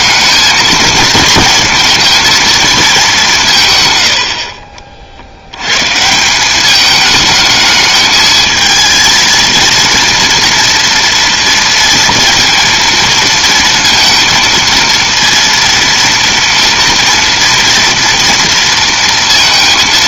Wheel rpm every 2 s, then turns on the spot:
220, 230, 60, 190, 220, 230, 230, 230, 230, 230.
none